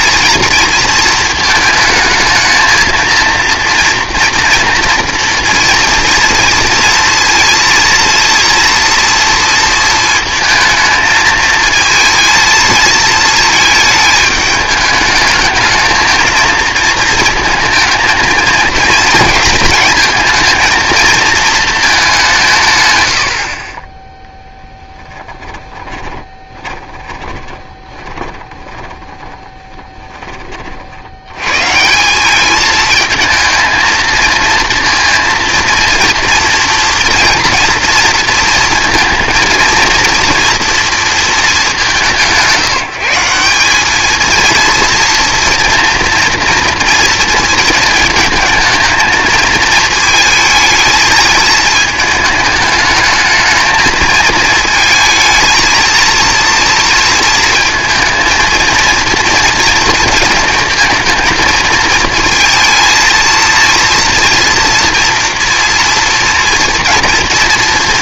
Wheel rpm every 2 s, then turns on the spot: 230, 220, 230, 230, 230, 220, 220, 210, 230, 230, 230, 150, 10, 20, 20, 30, 210, 230, 230, 230, 230, 160, 230, 230, 220, 220, 210, 230, 230, 230, 230, 220, 230, 230.
24-30